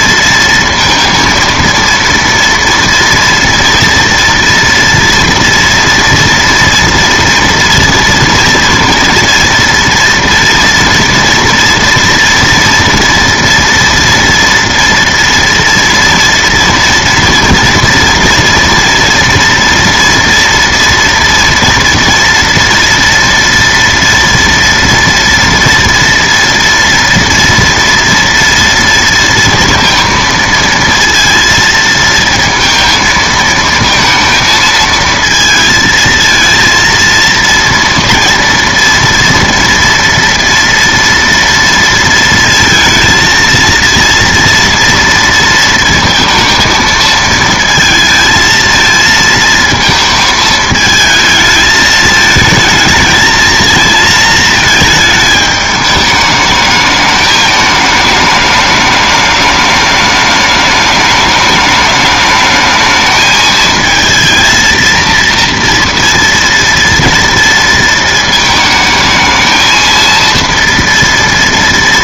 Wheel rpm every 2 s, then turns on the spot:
230, 230, 240, 230, 230, 230, 230, 230, 230, 230, 230, 230, 230, 230, 230, 230, 230, 220, 230, 230, 230, 230, 230, 230, 220, 220, 220, 220, 210, 210, 210, 220, 230, 230, 220, 230.
none